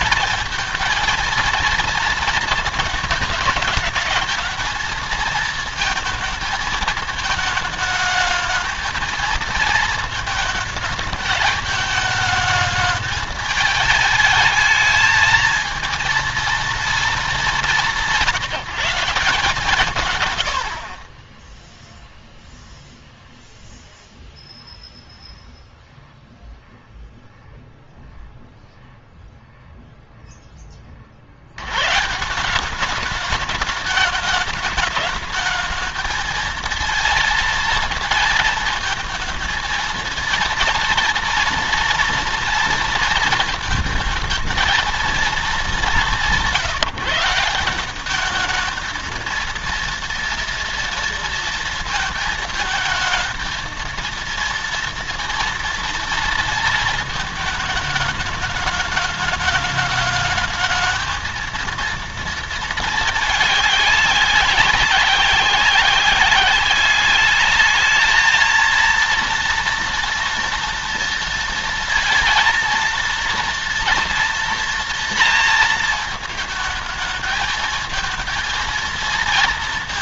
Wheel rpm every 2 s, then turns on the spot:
230, 230, 220, 220, 220, 220, 210, 220, 230, 160, 90, 0, 0, 0, 0, 10, 180, 210, 220, 230, 230, 230, 220, 170, 210, 230, 220, 230, 220, 210, 210, 220, 200, 200, 220, 230, 230, 230, 220, 220.
none